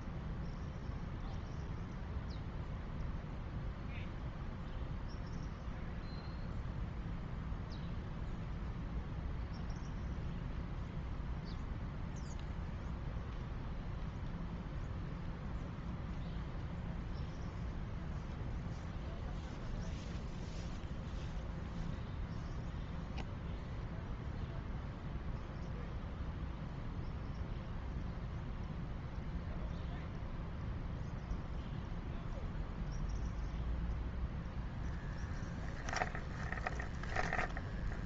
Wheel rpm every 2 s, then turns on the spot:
0, 0, 0, 0, 0, 0, 0, 0, 0, 0, 0, 0, 0, 0, 0, 0, 0, 0, 10.
none